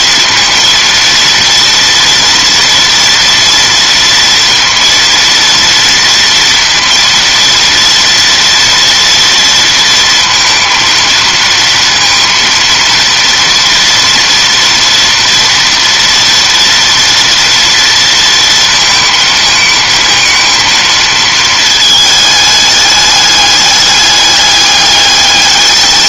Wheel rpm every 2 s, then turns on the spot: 230, 230, 230, 230, 230, 230, 230, 230, 230, 230, 230, 210, 200.
none